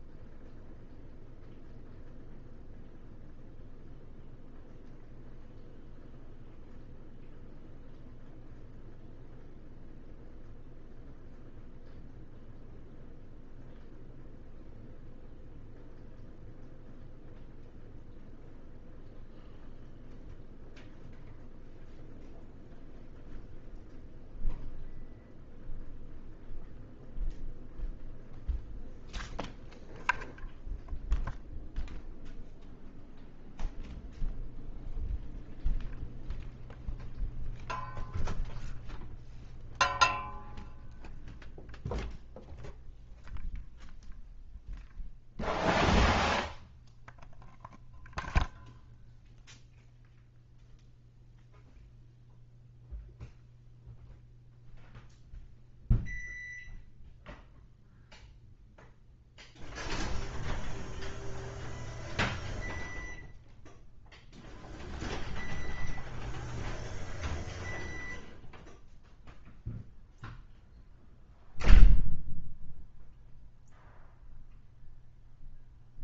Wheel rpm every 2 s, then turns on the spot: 0, 0, 0, 0, 0, 0, 0, 0, 0, 0, 0, 0, 0, 0, 0, 0, 0, 0, 0, 0, 0, 0, 0, 0, 0, 0, 0, 0, 0, 0, 0, 0, 0, 0, 0, 0, 0, 0.
none